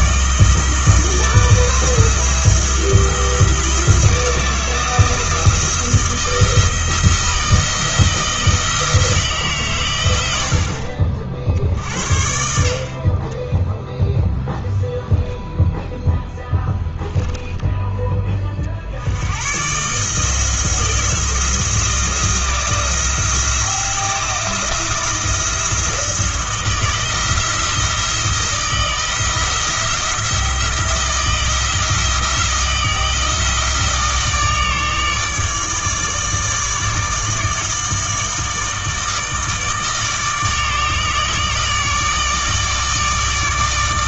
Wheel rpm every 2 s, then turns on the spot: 160, 170, 160, 160, 160, 60, 60, 0, 10, 60, 170, 170, 170, 170, 170, 170, 170, 150, 150, 160, 150, 150.
none